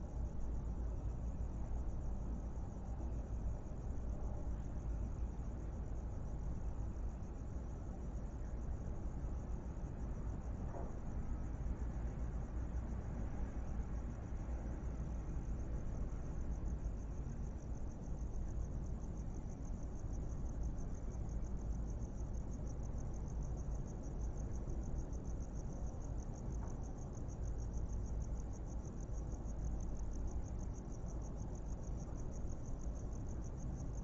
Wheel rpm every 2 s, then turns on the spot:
0, 0, 0, 0, 0, 0, 0, 0, 0, 0, 0, 0, 0, 0, 0, 0, 0.
none